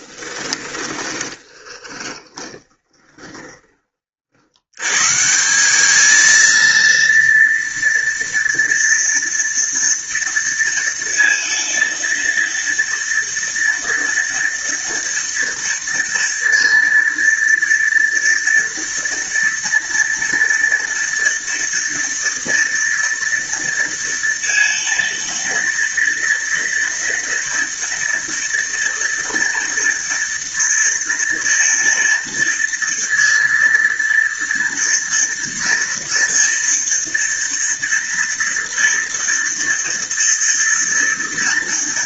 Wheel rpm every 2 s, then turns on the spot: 20, 20, 90, 230, 230, 230, 230, 230, 230, 230, 230, 230, 230, 230, 230, 230, 230, 230, 230, 230, 230.
0-4